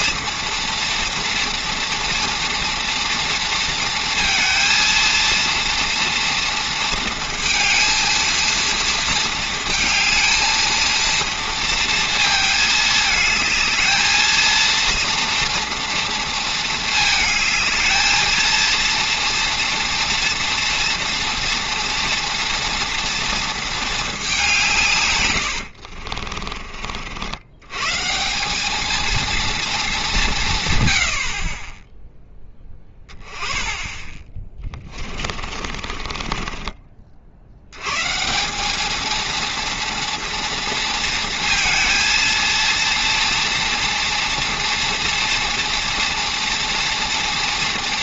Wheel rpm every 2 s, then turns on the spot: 230, 230, 230, 230, 230, 230, 220, 230, 220, 230, 230, 240, 170, 40, 200, 150, 10, 20, 30, 210, 230, 230, 230, 240.
34-36